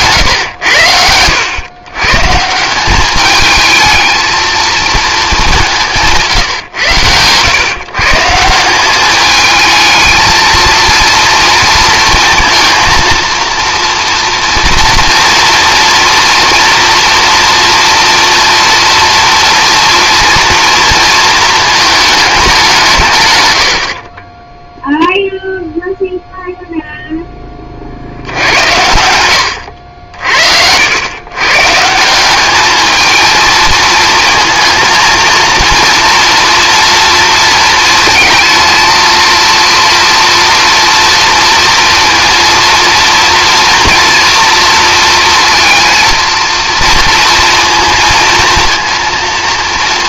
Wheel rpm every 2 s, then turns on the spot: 110, 170, 230, 130, 180, 230, 230, 230, 240, 230, 230, 180, 10, 0, 90, 90, 210, 230, 230, 230, 240, 230, 230, 230, 230.
none